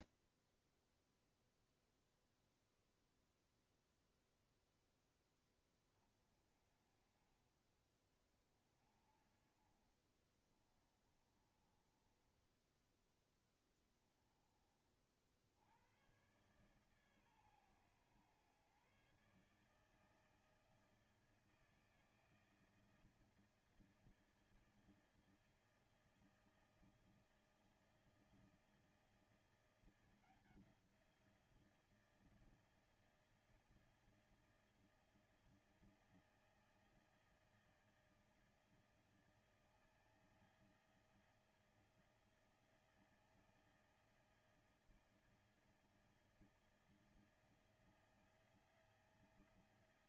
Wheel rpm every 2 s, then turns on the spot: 0, 0, 0, 30, 40, 30, 10, 40, 130, 130, 160, 160, 160, 160, 160, 170, 160, 160, 160, 160, 160, 160, 160, 160, 170.
10-12